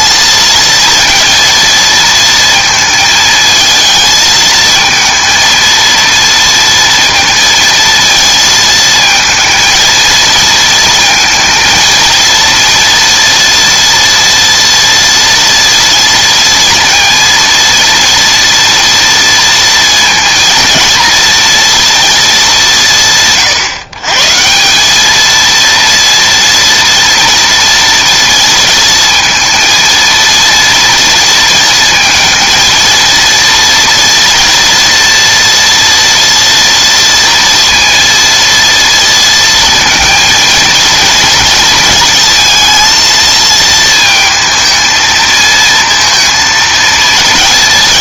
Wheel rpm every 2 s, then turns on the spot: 230, 230, 220, 230, 230, 230, 230, 230, 230, 230, 230, 190, 180, 230, 220, 230, 230, 230, 240, 230, 230, 230, 220, 230.
none